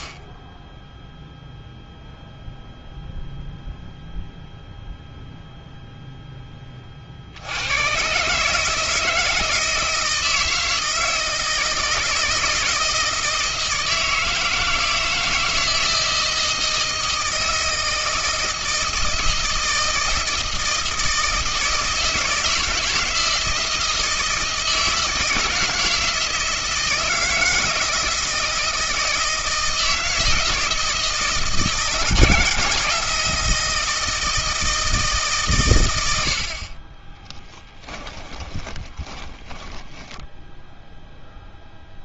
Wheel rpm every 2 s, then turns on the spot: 0, 0, 0, 20, 150, 160, 160, 160, 160, 160, 160, 160, 160, 160, 160, 160, 160, 160, 50, 20, 0.
38-40